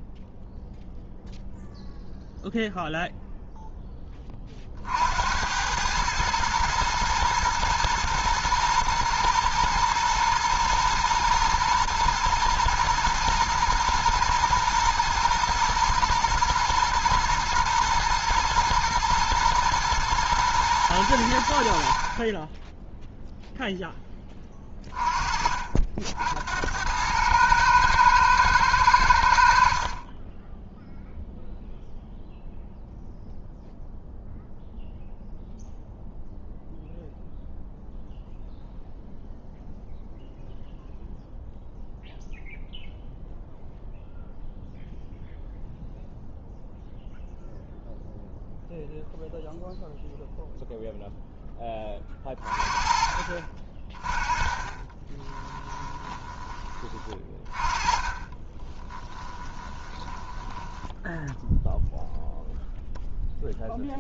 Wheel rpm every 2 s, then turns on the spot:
0, 0, 40, 110, 120, 110, 110, 110, 110, 110, 110, 20, 20, 90, 110, 10, 0, 0, 0, 0, 0, 0, 0, 0, 0, 0, 30, 20, 20, 20, 10, 0.
58-62